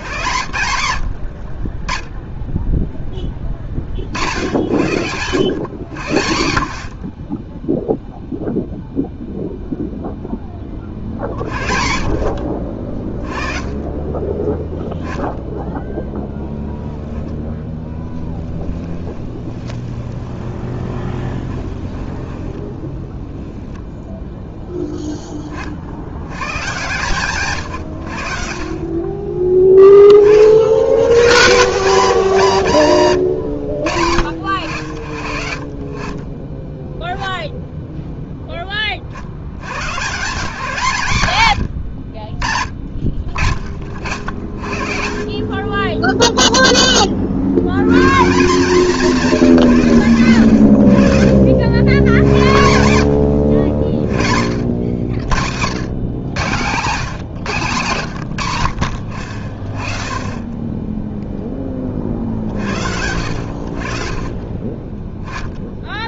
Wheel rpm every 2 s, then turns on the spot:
80, 0, 90, 50, 0, 40, 40, 0, 10, 20, 20, 0, 10, 140, 30, 110, 140, 70, 10, 60, 130, 40, 40, 40, 180, 80, 80, 70, 130, 100, 10, 60, 20.
18-22